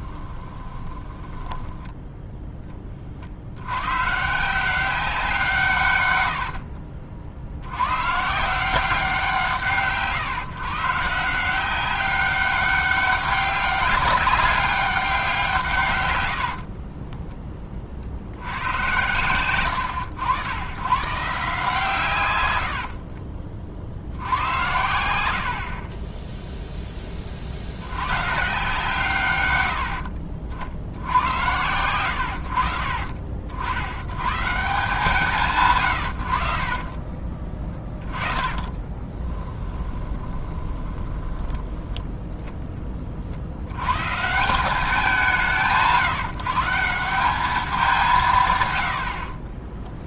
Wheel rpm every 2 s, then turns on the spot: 20, 20, 180, 60, 180, 140, 200, 190, 40, 110, 120, 70, 90, 10, 150, 60, 60, 170, 50, 20, 20, 20, 180, 170, 100.
0-2 6-8 16-18 22-24 36-42